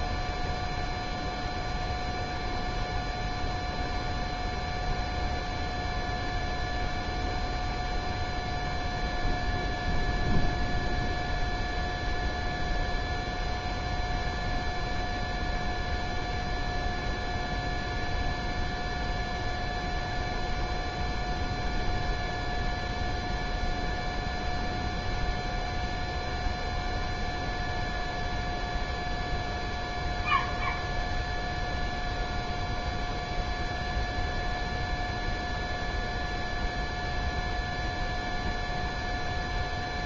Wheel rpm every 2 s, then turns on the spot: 0, 0, 0, 0, 0, 0, 0, 0, 0, 0, 0, 0, 0, 0, 0, 0, 0, 0, 0, 0.
none